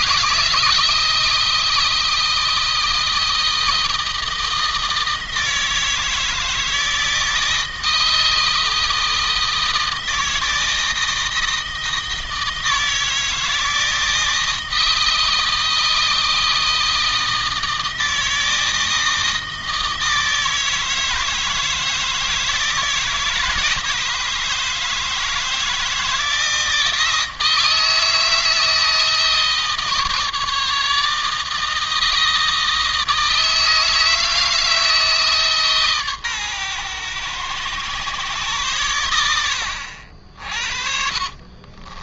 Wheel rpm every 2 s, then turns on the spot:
160, 160, 160, 160, 160, 160, 160, 160, 160, 160, 160, 160, 160, 160, 160, 160, 160, 160, 120, 110, 50.
40-42